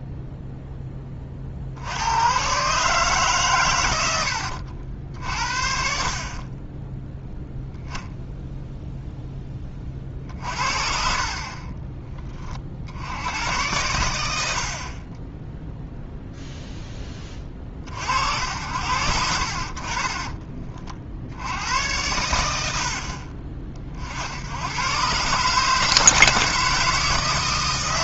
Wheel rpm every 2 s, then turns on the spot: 10, 140, 70, 20, 0, 40, 50, 70, 0, 80, 30, 70, 100, 160.
none